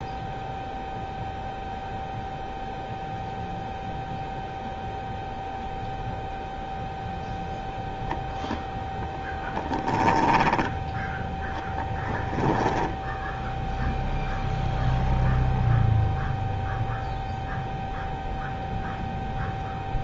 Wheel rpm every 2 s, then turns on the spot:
0, 0, 0, 0, 0, 10, 0, 0, 0, 0.
10-12